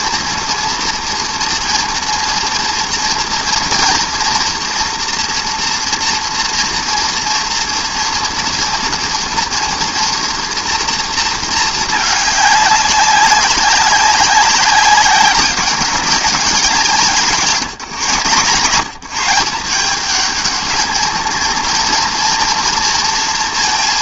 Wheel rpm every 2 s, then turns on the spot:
230, 230, 230, 240, 230, 230, 200, 190, 170, 160, 220, 230.
none